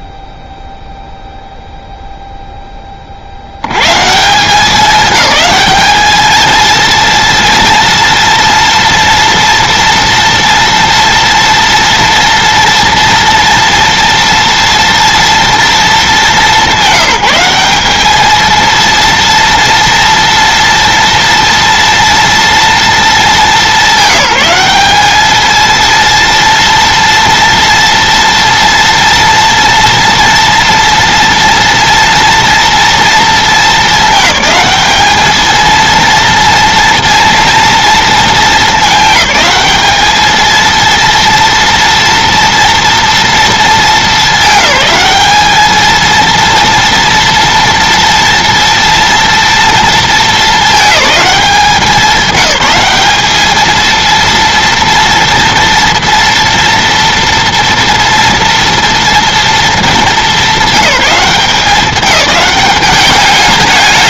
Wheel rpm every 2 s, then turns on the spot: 0, 10, 190, 230, 230, 230, 230, 230, 190, 230, 230, 230, 200, 230, 230, 230, 230, 210, 230, 210, 230, 230, 200, 230, 230, 220, 210, 230, 230, 230, 200, 190.
none